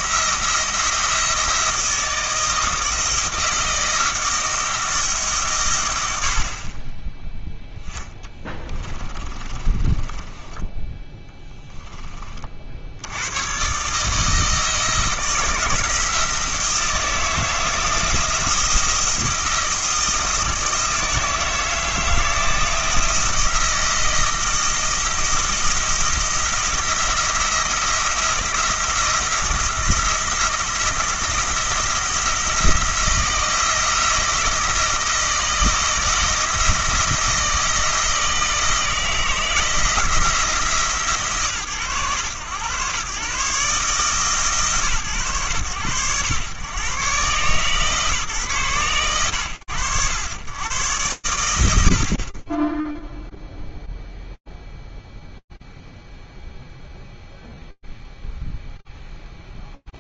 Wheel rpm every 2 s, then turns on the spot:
170, 160, 160, 50, 20, 10, 60, 160, 160, 170, 160, 160, 160, 170, 170, 170, 170, 160, 160, 160, 140, 120, 120, 120, 80, 120, 0, 0, 0, 0.
6-12